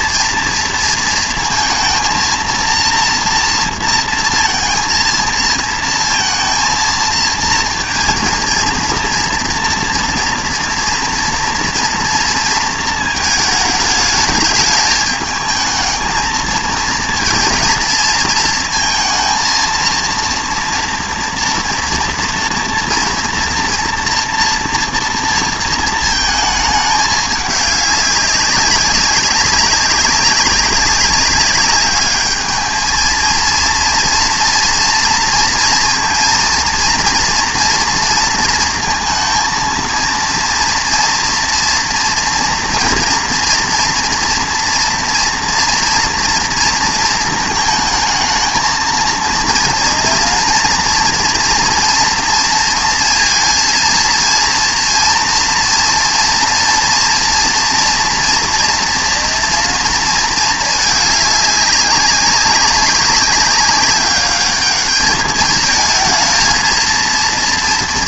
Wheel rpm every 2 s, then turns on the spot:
230, 230, 230, 230, 230, 230, 230, 210, 230, 230, 230, 230, 230, 220, 200, 200, 220, 230, 230, 230, 230, 230, 230, 230, 220, 240, 230, 230, 240, 230, 220, 190, 210, 230.
none